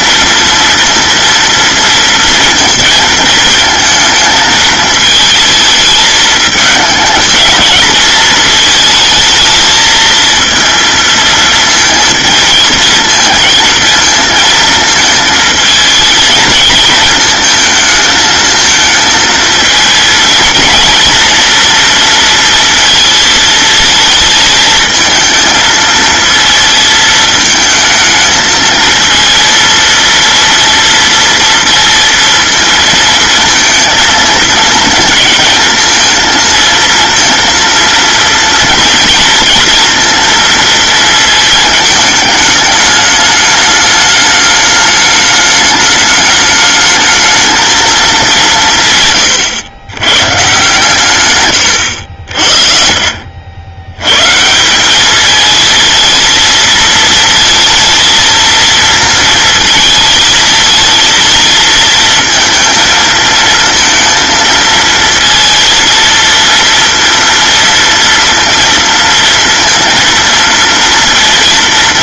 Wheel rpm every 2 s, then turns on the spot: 230, 230, 220, 220, 220, 230, 230, 230, 220, 220, 230, 230, 220, 220, 220, 230, 230, 220, 230, 240, 230, 210, 210, 210, 180, 140, 50, 150, 220, 230, 220, 230, 220, 230, 230, 230.
52-54